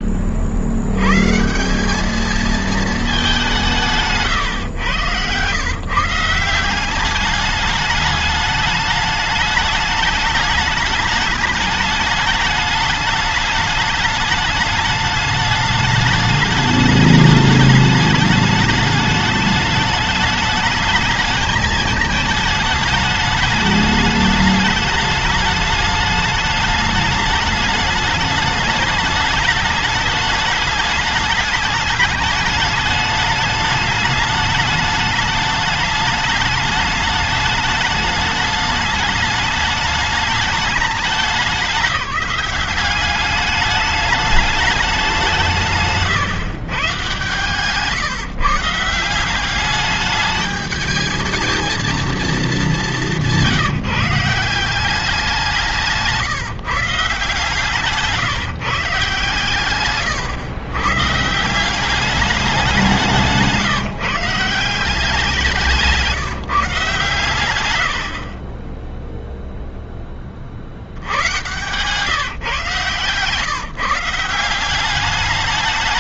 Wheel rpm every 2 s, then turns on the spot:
50, 220, 140, 170, 210, 210, 210, 210, 210, 210, 210, 210, 210, 210, 210, 210, 210, 210, 210, 210, 210, 200, 210, 140, 150, 210, 220, 170, 150, 160, 140, 200, 170, 160, 40, 40, 140, 180.
none